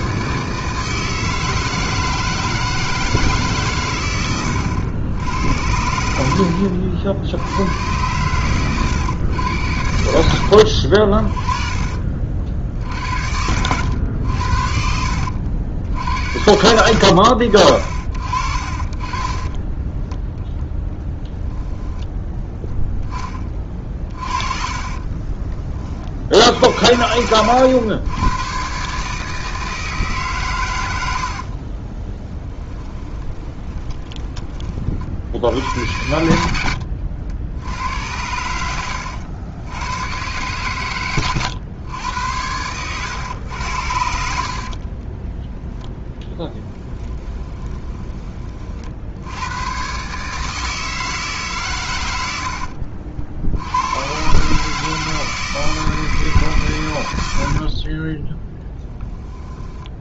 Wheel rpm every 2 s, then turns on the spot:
160, 160, 90, 70, 120, 70, 60, 70, 90, 40, 0, 10, 30, 80, 140, 110, 10, 40, 80, 90, 120, 100, 50, 10, 50, 160, 70, 150, 120, 10.
18-20 24-26 32-34 36-40 42-48 52-54